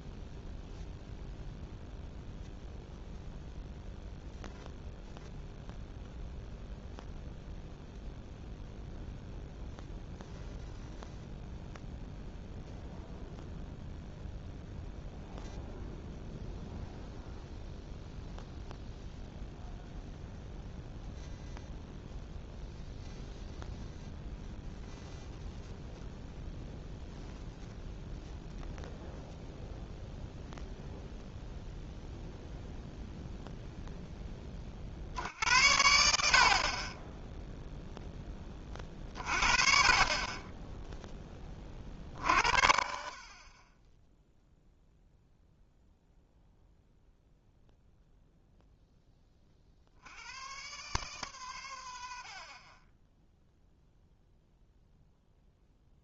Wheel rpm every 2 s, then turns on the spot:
0, 0, 0, 0, 0, 0, 0, 0, 0, 0, 0, 0, 0, 0, 0, 0, 0, 30, 50, 20, 20, 60, 0, 0, 0, 120, 40, 0.
52-54